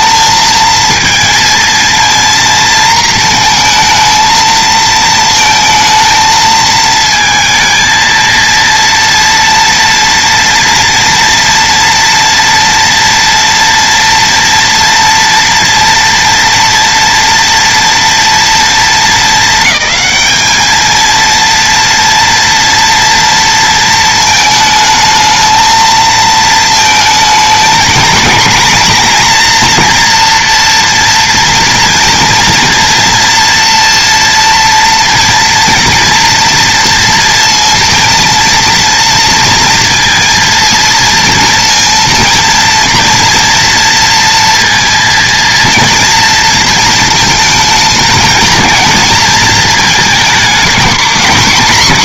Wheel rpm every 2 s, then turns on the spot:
230, 230, 220, 220, 230, 230, 230, 230, 240, 220, 220, 230, 220, 220, 230, 240, 230, 230, 230, 230, 230, 230, 240, 230, 230, 220.
none